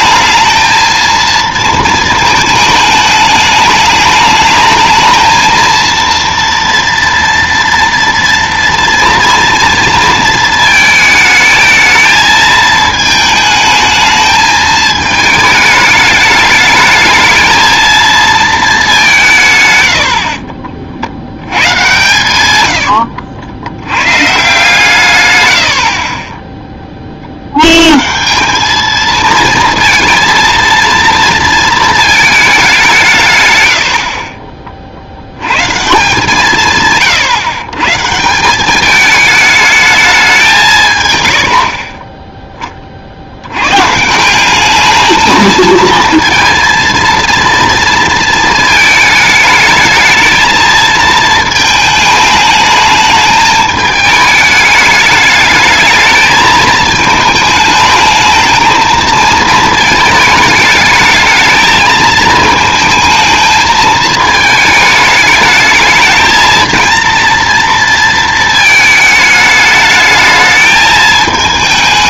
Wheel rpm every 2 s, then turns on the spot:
220, 220, 220, 230, 230, 220, 220, 220, 220, 220, 40, 90, 150, 10, 200, 230, 190, 50, 160, 190, 160, 20, 200, 230, 220, 220, 210, 210, 220, 220, 220, 220, 210, 230, 220, 220.
22-24